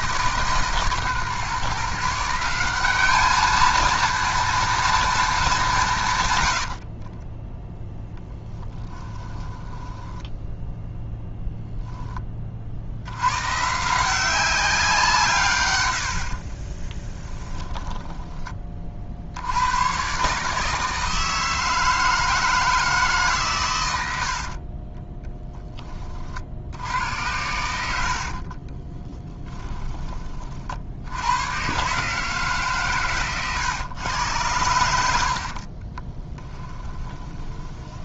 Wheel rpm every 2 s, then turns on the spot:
140, 200, 230, 50, 10, 0, 70, 180, 20, 30, 160, 160, 20, 90, 30, 60, 140, 80, 20.
6-10 16-18 28-30 36-38